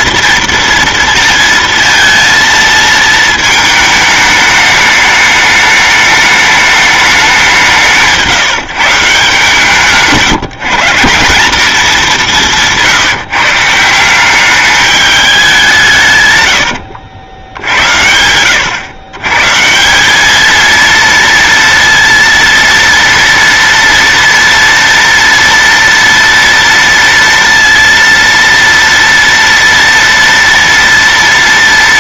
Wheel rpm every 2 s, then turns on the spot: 230, 230, 210, 210, 160, 160, 180, 200, 110, 110, 230, 230, 230, 230, 230, 230.
16-18